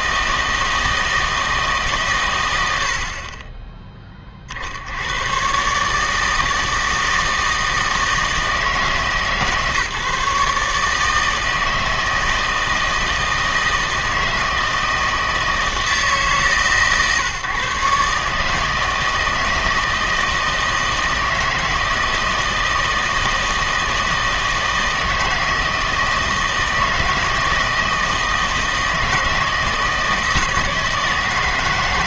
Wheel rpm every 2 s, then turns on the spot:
160, 90, 70, 160, 160, 150, 160, 160, 150, 160, 160, 160, 160, 160, 160, 160.
none